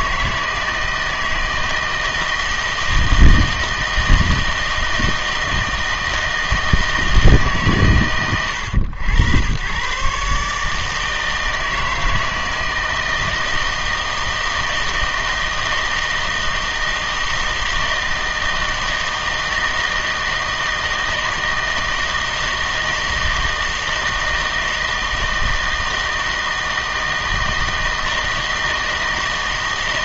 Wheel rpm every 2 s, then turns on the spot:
160, 160, 160, 160, 100, 150, 160, 160, 160, 160, 160, 160, 160, 160, 160.
none